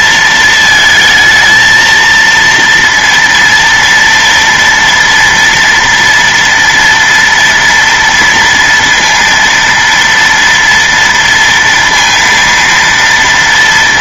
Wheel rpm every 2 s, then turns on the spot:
220, 230, 230, 240, 230, 230, 230.
none